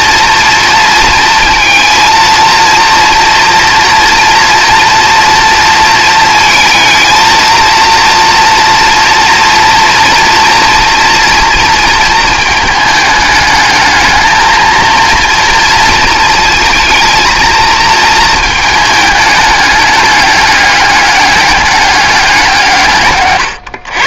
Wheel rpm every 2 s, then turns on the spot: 230, 230, 230, 220, 230, 230, 210, 230, 230, 220, 210, 170.
none